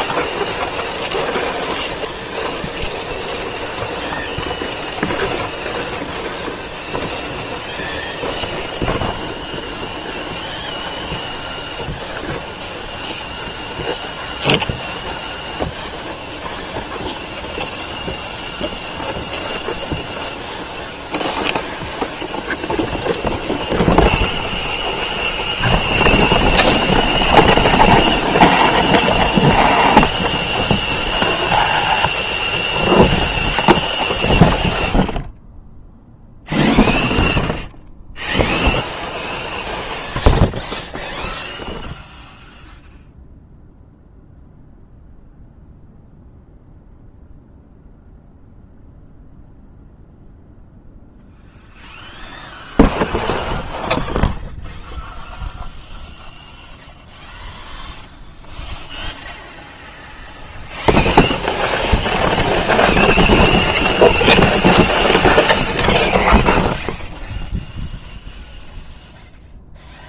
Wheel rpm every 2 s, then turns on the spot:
0, 0, 0, 0, 0, 0, 0, 0, 0, 0, 0, 0, 0, 0, 0, 0, 0, 0, 0, 0, 0, 0, 0, 0, 0, 0, 0, 0, 0, 0, 0, 0, 0, 0, 0.
none